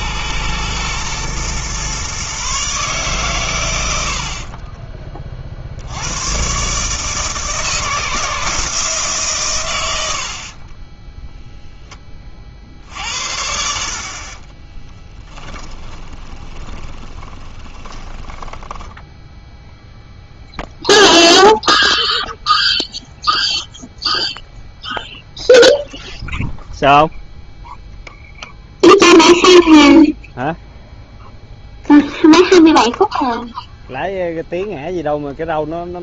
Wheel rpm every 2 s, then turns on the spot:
110, 140, 30, 140, 160, 30, 60, 10, 20, 10, 0, 0, 0, 0, 0, 0, 0, 0.
4-6 10-12 14-20